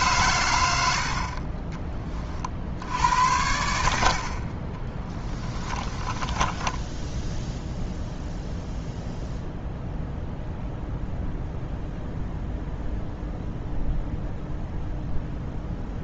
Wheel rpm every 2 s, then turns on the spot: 90, 60, 20, 10, 0, 0, 0, 0.
4-8